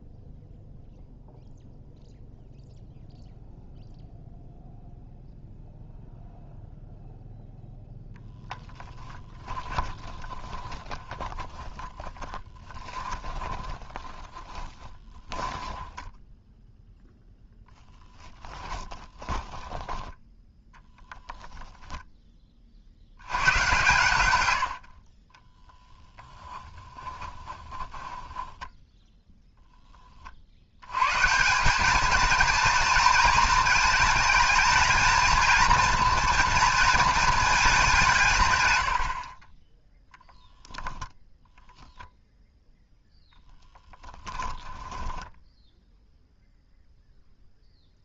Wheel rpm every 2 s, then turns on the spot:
0, 0, 0, 0, 0, 30, 20, 20, 0, 10, 20, 50, 70, 10, 10, 80, 230, 220, 230, 110, 0, 0, 10, 0.
10-16 18-22 26-30 44-46